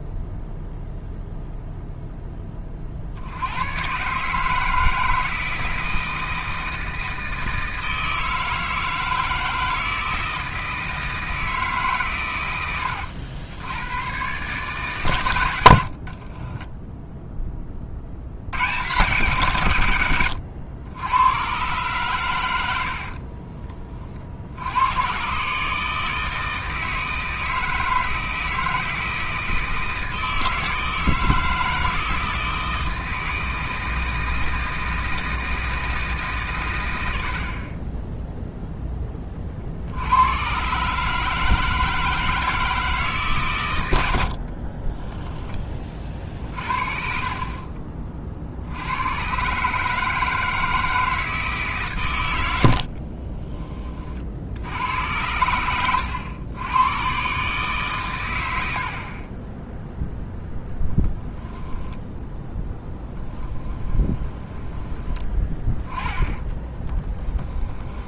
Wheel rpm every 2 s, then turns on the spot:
0, 40, 160, 160, 160, 160, 90, 140, 10, 130, 100, 70, 90, 160, 160, 160, 160, 160, 110, 10, 140, 160, 30, 40, 90, 160, 60, 80, 120, 60, 0, 10, 20, 10.
16-18 44-46 52-54 62-64 66-68